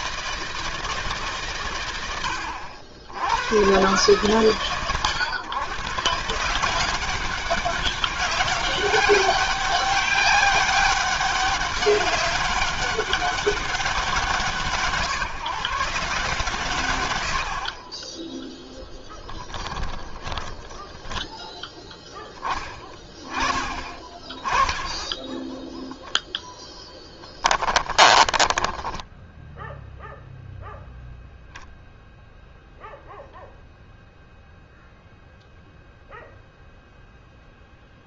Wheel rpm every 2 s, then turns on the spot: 160, 90, 130, 150, 190, 200, 200, 160, 130, 10, 10, 10, 10, 0, 10, 0, 0, 0, 0.
28-30